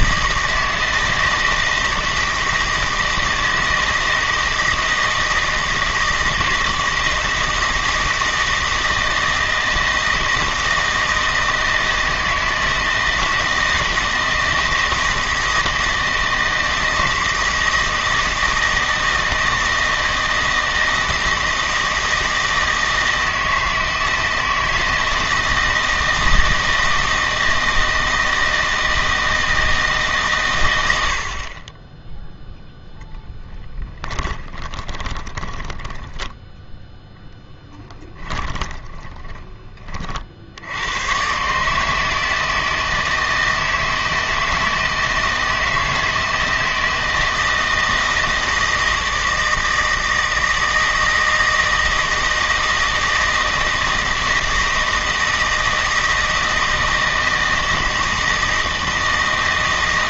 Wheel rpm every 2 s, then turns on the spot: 160, 160, 160, 160, 160, 160, 160, 160, 160, 160, 160, 160, 160, 160, 160, 110, 0, 20, 0, 20, 80, 160, 160, 160, 160, 160, 160, 160, 160, 160.
34-36 38-40